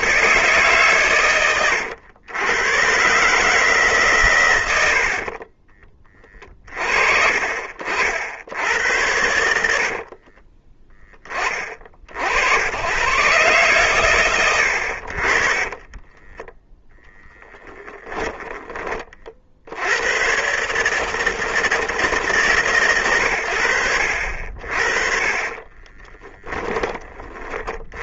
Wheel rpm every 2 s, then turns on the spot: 130, 110, 100, 30, 80, 30, 100, 120, 10, 20, 140, 140, 50, 20.
10-12 16-18